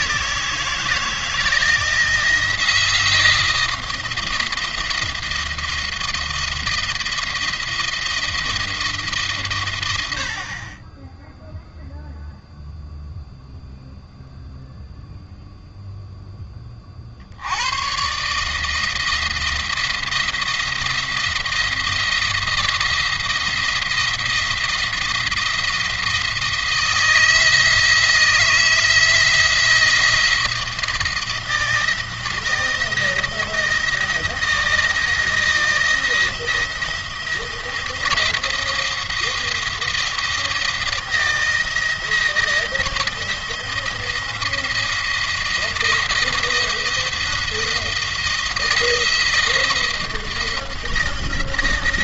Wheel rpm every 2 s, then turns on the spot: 160, 160, 160, 170, 160, 30, 0, 0, 30, 160, 170, 170, 170, 160, 160, 170, 160, 170, 170, 170, 170, 160, 170, 170, 170, 170.
none